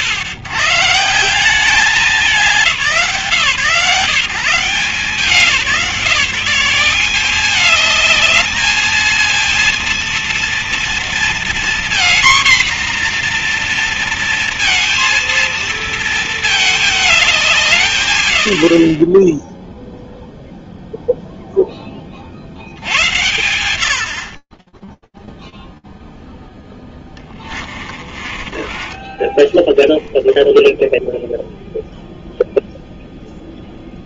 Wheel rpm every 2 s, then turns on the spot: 150, 180, 170, 190, 220, 230, 240, 230, 220, 100, 0, 60, 50, 10, 20, 0, 0.
26-28